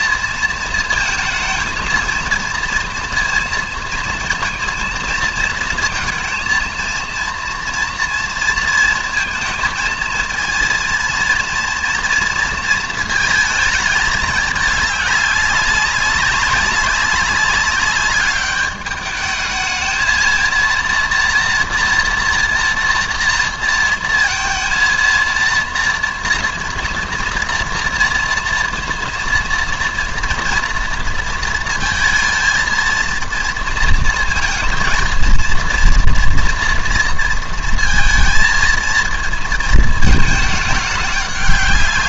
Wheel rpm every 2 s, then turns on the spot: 230, 230, 220, 230, 230, 230, 230, 210, 200, 210, 230, 230, 230, 230, 230, 230, 230, 230, 230, 230, 210.
none